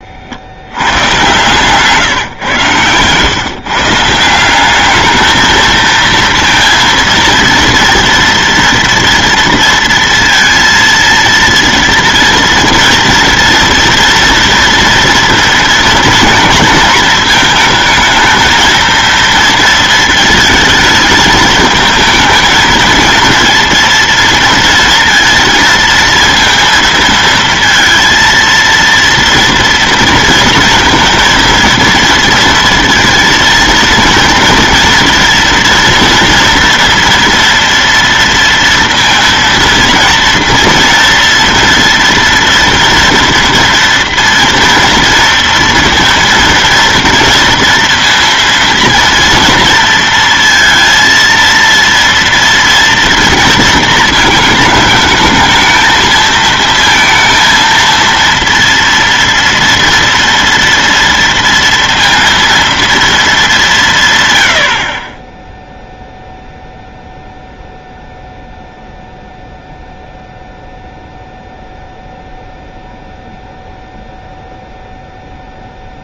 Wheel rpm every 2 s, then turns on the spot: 90, 130, 190, 230, 230, 230, 230, 240, 230, 230, 220, 220, 230, 230, 230, 230, 230, 230, 240, 230, 230, 230, 230, 230, 230, 230, 230, 220, 230, 230, 230, 230, 90, 0, 0, 0, 0, 0.
none